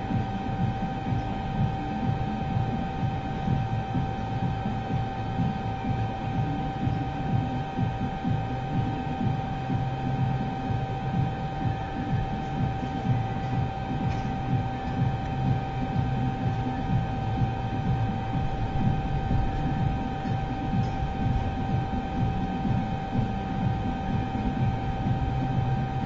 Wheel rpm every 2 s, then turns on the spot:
0, 0, 0, 0, 0, 0, 0, 0, 0, 0, 0, 0, 0.
none